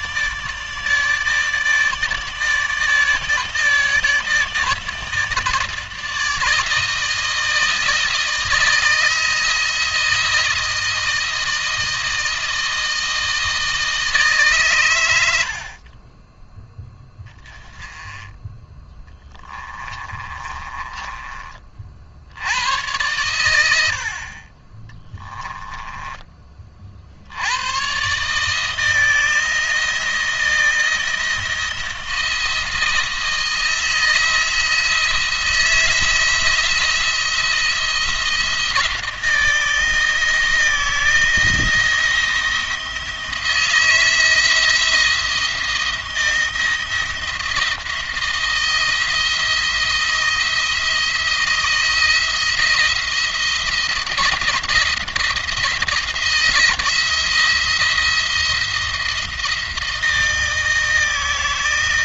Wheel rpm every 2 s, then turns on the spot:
150, 150, 160, 160, 160, 160, 160, 120, 10, 10, 20, 100, 30, 50, 160, 170, 170, 170, 170, 160, 160, 170, 170, 170, 170, 170, 170, 170, 160, 170, 160.
18-22 24-26